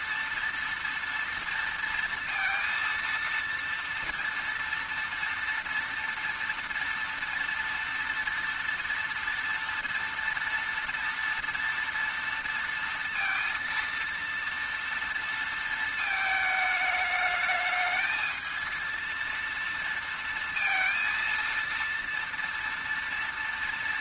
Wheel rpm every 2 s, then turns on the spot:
230, 230, 230, 230, 230, 230, 230, 230, 220, 220, 230, 230.
none